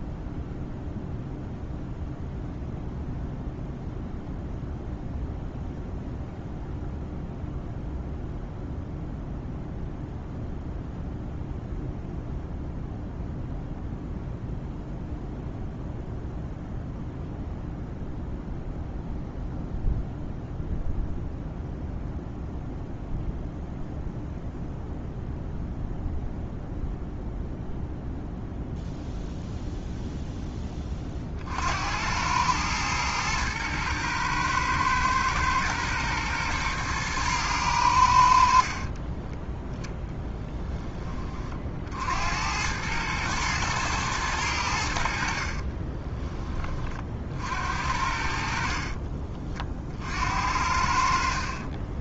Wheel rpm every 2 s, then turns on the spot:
0, 0, 0, 0, 0, 0, 0, 0, 0, 0, 0, 0, 0, 0, 0, 20, 110, 110, 110, 30, 20, 100, 70, 40, 40, 60.
38-40 48-50